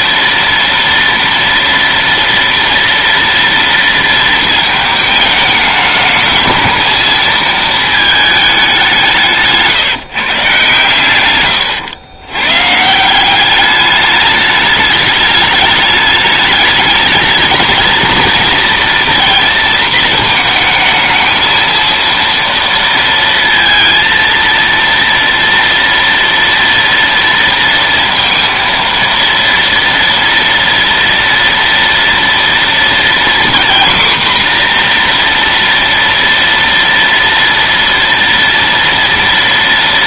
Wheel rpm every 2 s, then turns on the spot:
230, 230, 220, 220, 200, 140, 130, 210, 210, 230, 220, 230, 230, 230, 230, 230, 240, 250, 230, 230.
none